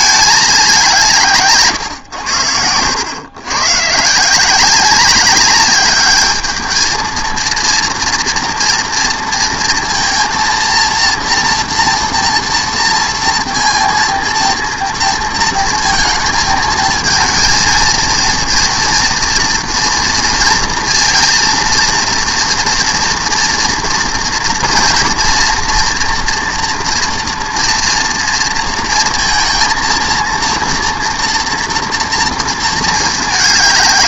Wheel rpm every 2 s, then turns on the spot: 190, 90, 180, 220, 230, 230, 230, 230, 220, 230, 230, 240, 230, 230, 230, 230, 230.
none